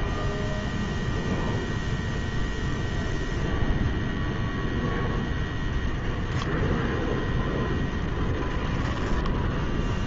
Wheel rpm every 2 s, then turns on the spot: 0, 0, 0, 0, 0.
none